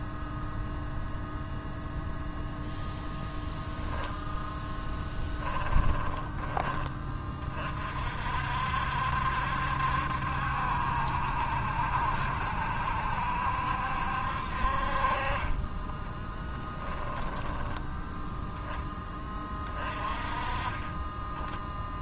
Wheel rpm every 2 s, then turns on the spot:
0, 10, 10, 20, 60, 70, 70, 50, 10, 10, 30.
4-6